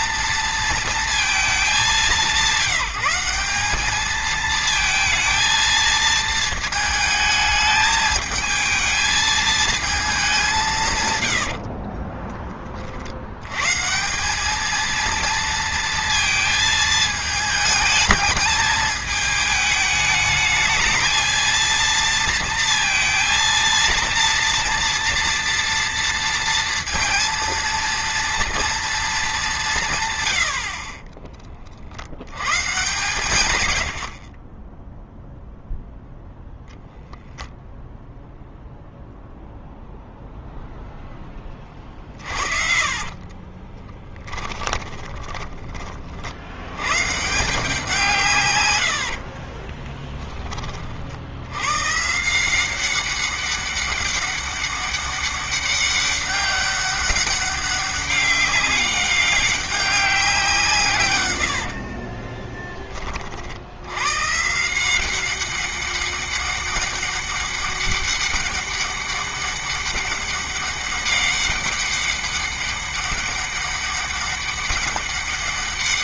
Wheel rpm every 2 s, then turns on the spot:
230, 190, 230, 220, 220, 150, 40, 220, 220, 210, 220, 230, 230, 230, 220, 40, 130, 10, 0, 0, 0, 30, 20, 120, 110, 40, 180, 200, 200, 200, 140, 40, 170, 200, 200, 200, 200, 200.
30-32 42-46 48-50